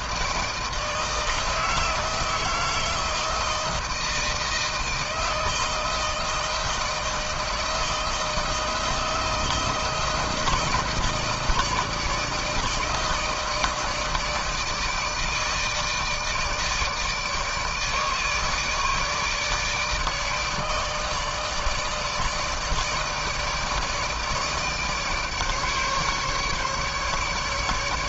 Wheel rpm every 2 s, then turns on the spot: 160, 160, 160, 160, 160, 160, 160, 160, 160, 160, 160, 160, 160, 150.
none